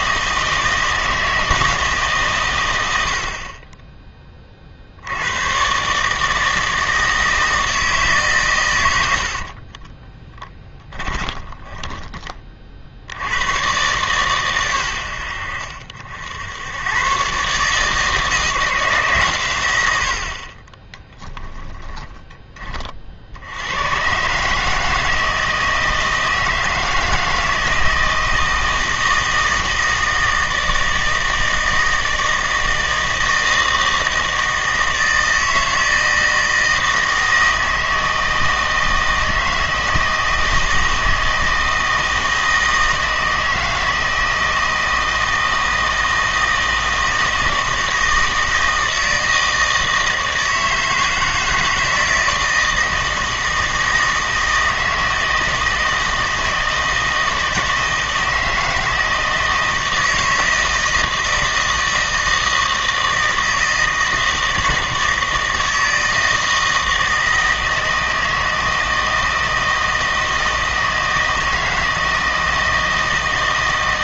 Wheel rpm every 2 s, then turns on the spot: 160, 100, 50, 160, 110, 20, 40, 120, 100, 160, 20, 30, 150, 160, 160, 160, 160, 160, 160, 160, 160, 160, 160, 160, 160, 160, 160, 160, 160, 160, 160, 160, 160, 160, 160, 160, 160.
10-12 20-22